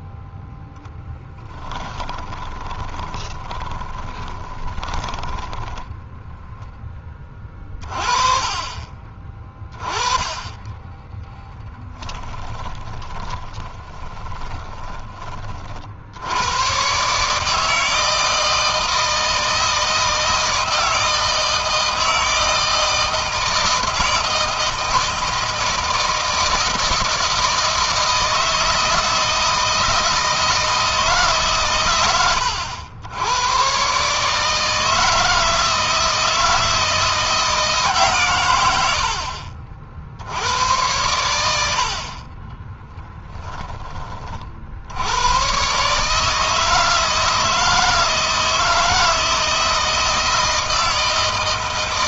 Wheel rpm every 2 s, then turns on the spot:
10, 20, 20, 10, 30, 10, 10, 20, 120, 160, 160, 160, 160, 160, 160, 160, 90, 160, 160, 90, 90, 10, 70, 160, 160, 160.
2-6 12-16 42-44